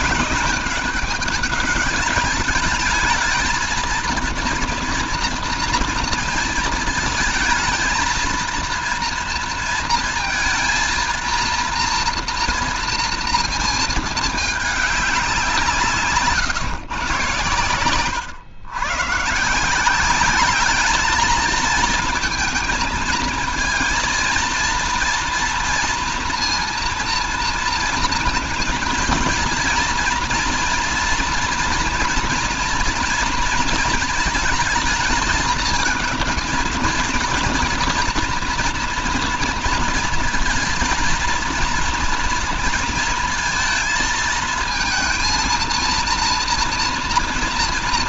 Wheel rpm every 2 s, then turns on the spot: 210, 210, 230, 230, 230, 230, 230, 210, 130, 120, 210, 220, 230, 230, 230, 240, 230, 220, 220, 230, 230, 230, 220, 230.
none